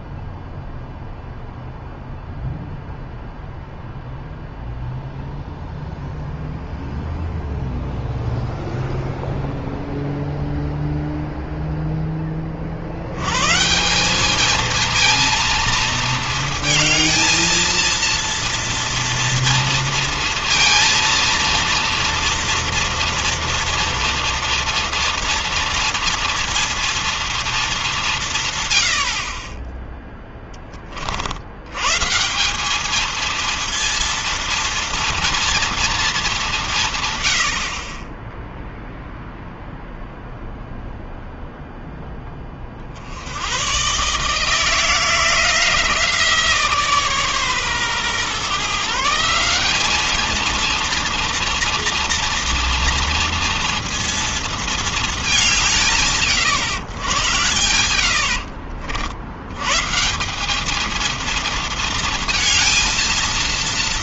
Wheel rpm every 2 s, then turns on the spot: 0, 0, 0, 0, 0, 0, 100, 230, 220, 230, 230, 230, 230, 230, 60, 50, 220, 230, 120, 0, 0, 60, 170, 150, 160, 230, 230, 200, 90, 60, 220, 230.
none